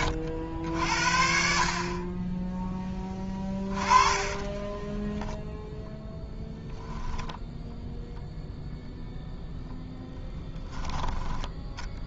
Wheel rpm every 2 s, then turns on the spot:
70, 10, 20, 0, 0, 10.
4-6